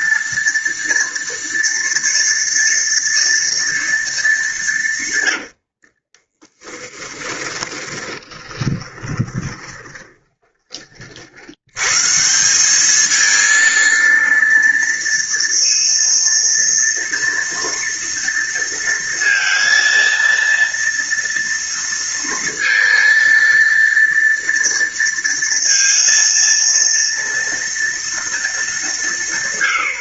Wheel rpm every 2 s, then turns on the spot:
230, 230, 200, 20, 20, 20, 160, 230, 230, 230, 230, 230, 230, 230, 230.
6-12